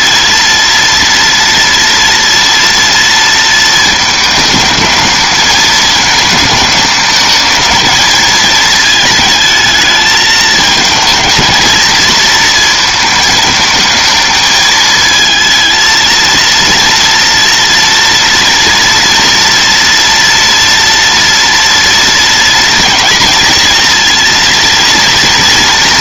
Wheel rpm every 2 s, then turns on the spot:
240, 230, 220, 220, 220, 230, 220, 220, 230, 230, 230, 230, 230.
none